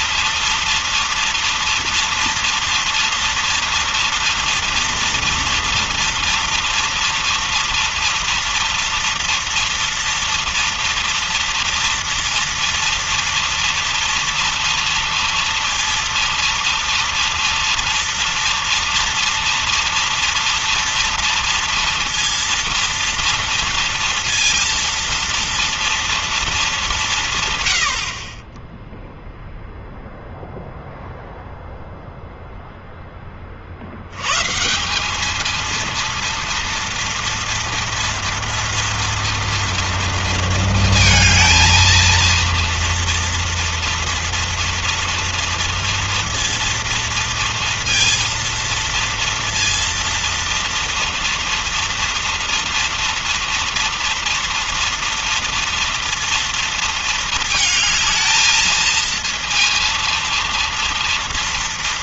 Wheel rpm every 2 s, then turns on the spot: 230, 230, 230, 230, 230, 230, 230, 230, 230, 230, 230, 230, 230, 220, 30, 0, 0, 120, 230, 230, 230, 230, 230, 230, 230, 230, 230, 230, 230, 220, 230.
none